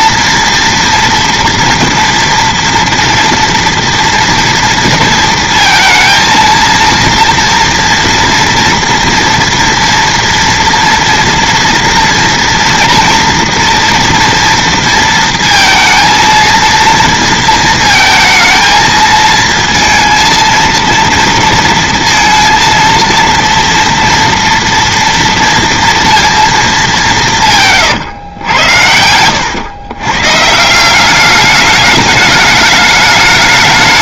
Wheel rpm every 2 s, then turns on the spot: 230, 230, 230, 230, 230, 240, 230, 230, 230, 220, 230, 230, 230, 230, 100, 150, 210.
none